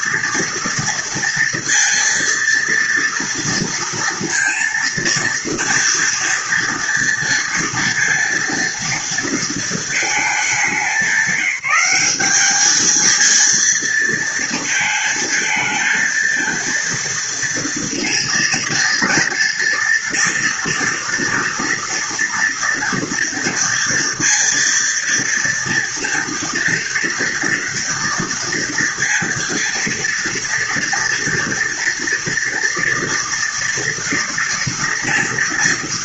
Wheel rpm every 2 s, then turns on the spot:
230, 230, 230, 230, 230, 200, 210, 230, 230, 230, 230, 230, 230, 230, 230, 240, 230, 230.
none